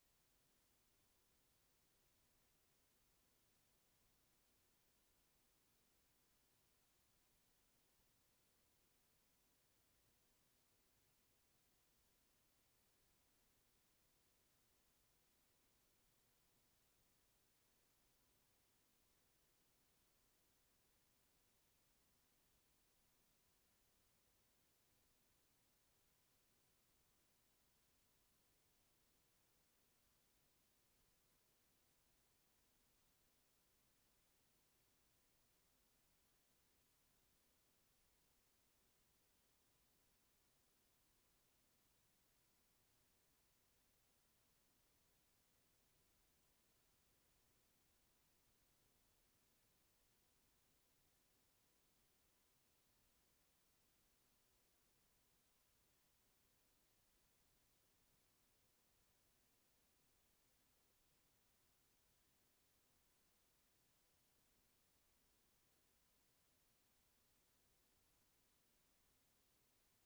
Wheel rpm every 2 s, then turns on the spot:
0, 0, 0, 0, 0, 0, 0, 0, 0, 0, 0, 0, 0, 0, 0, 0, 0, 0, 0, 0, 0, 0, 0, 0, 0, 0, 0, 0, 0, 0, 0, 0, 0, 0, 0.
none